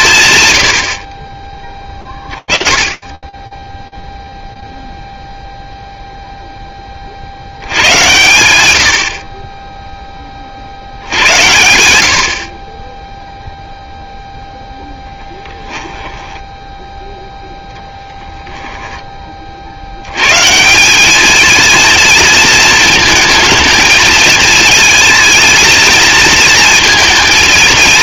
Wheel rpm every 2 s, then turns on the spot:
60, 20, 0, 30, 70, 80, 0, 10, 0, 30, 210, 230, 220, 230.
14-16